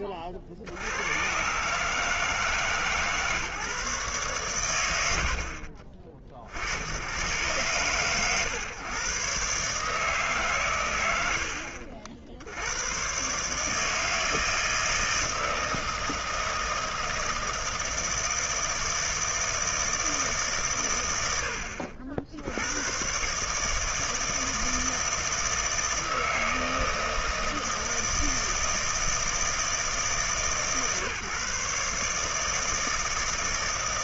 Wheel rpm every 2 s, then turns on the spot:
30, 160, 120, 60, 130, 130, 90, 160, 160, 160, 110, 110, 160, 160, 160, 140, 160.
none